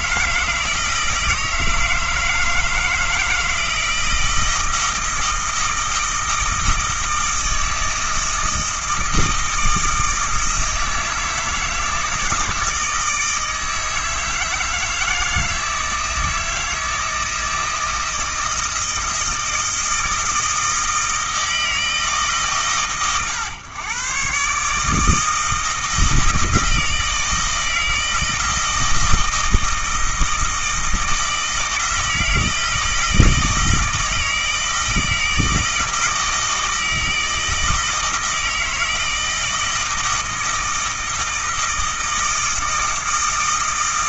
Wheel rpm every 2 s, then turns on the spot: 160, 160, 160, 160, 160, 160, 160, 160, 160, 160, 160, 140, 150, 160, 160, 160, 160, 160, 160, 160, 160, 160.
none